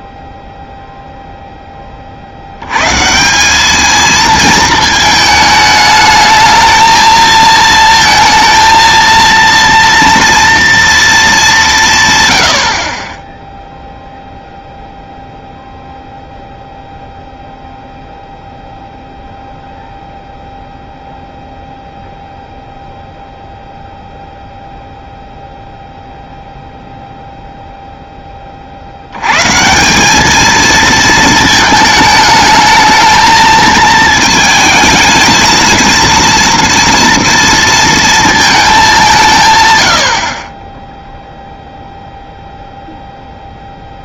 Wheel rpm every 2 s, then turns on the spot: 0, 100, 220, 220, 230, 230, 50, 0, 0, 0, 0, 0, 0, 0, 40, 220, 220, 220, 240, 210, 20, 0.
none